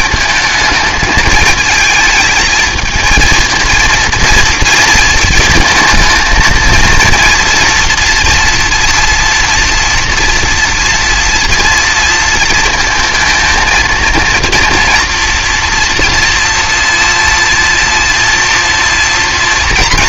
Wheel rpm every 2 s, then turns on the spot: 220, 220, 230, 220, 230, 230, 230, 230, 230, 230.
none